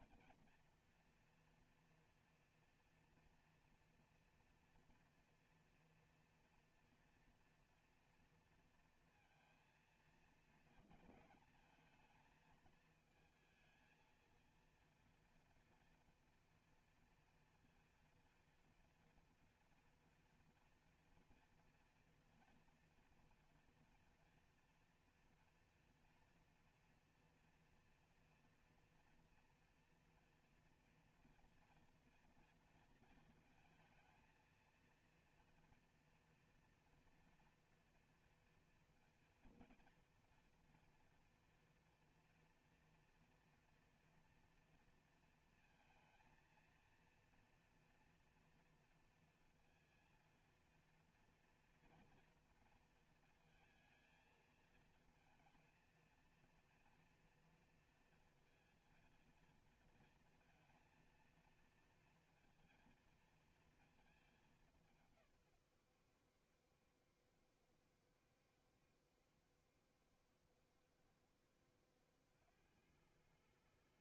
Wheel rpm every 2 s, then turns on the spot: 240, 230, 230, 230, 230, 230, 220, 230, 230, 240, 230, 230, 230, 230, 230, 230, 230, 230, 230, 230, 240, 230, 230, 230, 240, 230, 230, 230, 230, 230, 230, 230, 210, 80, 70, 70, 80.
none